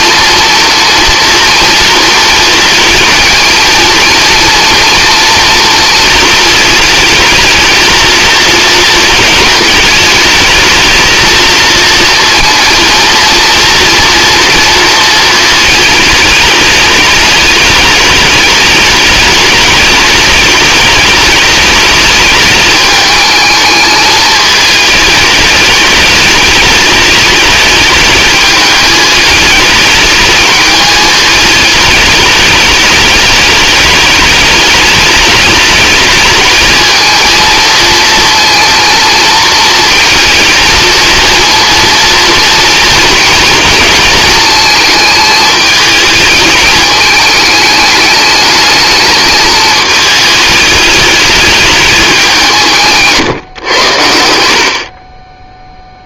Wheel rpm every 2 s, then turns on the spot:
230, 220, 230, 220, 230, 220, 230, 230, 210, 210, 210, 210, 220, 210, 210, 210, 210, 210, 220, 230, 230, 230, 220, 210, 220, 210, 150, 40.
none